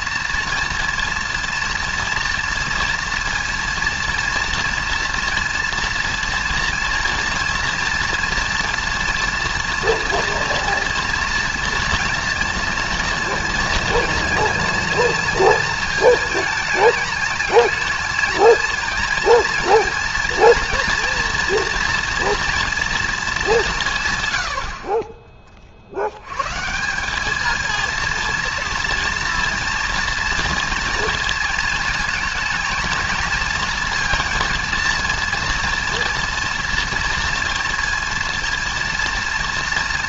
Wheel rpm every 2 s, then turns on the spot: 230, 230, 230, 230, 230, 230, 230, 240, 220, 230, 230, 230, 50, 150, 230, 230, 220, 230, 230, 230.
none